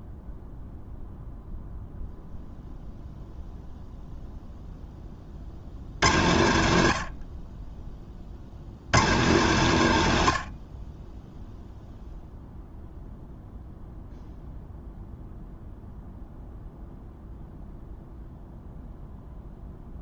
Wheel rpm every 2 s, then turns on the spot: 0, 0, 20, 70, 120, 20, 0, 0, 0, 0.
none